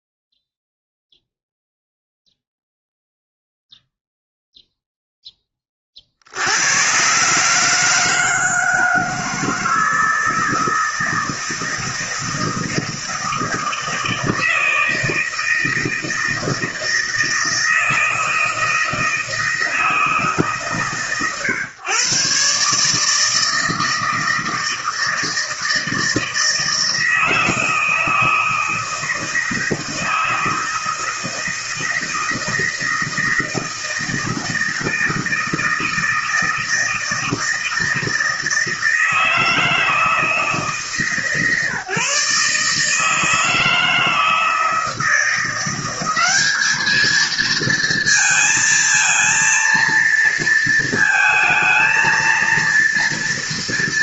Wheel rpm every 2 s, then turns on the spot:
0, 0, 0, 80, 160, 160, 160, 160, 160, 160, 140, 140, 160, 160, 160, 160, 160, 160, 160, 160, 160, 150, 160, 210, 220, 230, 230.
none